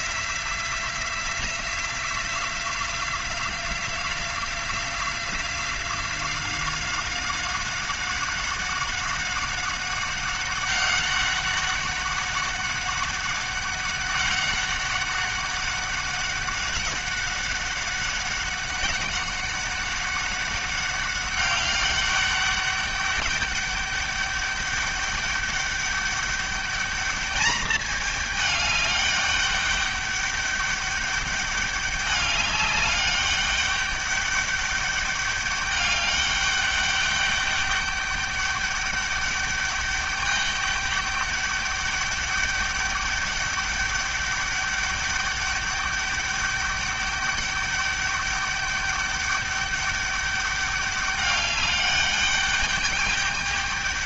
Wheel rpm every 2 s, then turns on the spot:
180, 180, 180, 190, 190, 200, 200, 200, 200, 190, 190, 200, 200, 210, 210, 200, 200, 200, 200, 200, 200, 200, 200, 200, 200, 200, 200.
none